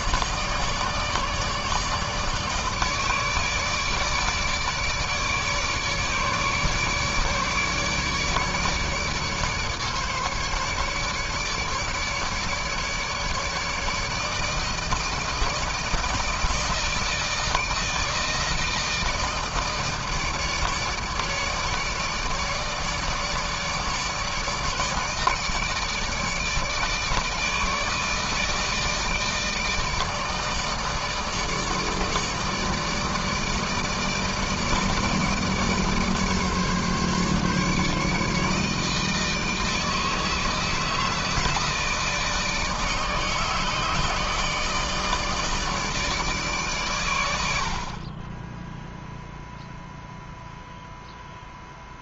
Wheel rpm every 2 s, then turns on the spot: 150, 150, 150, 150, 150, 150, 150, 160, 160, 160, 150, 150, 160, 160, 160, 160, 150, 150, 150, 160, 160, 160, 160, 110, 0, 0.
none